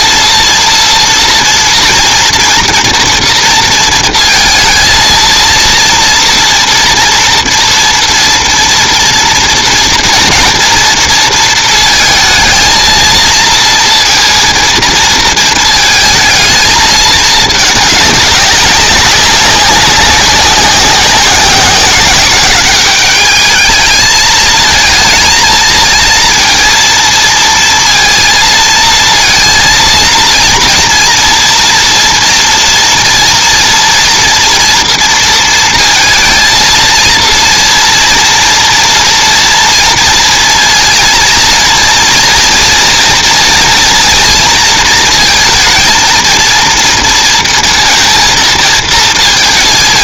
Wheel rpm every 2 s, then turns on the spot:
230, 230, 230, 230, 230, 230, 220, 230, 220, 200, 190, 190, 220, 230, 230, 230, 230, 230, 230, 230, 230, 230, 230, 230, 230.
none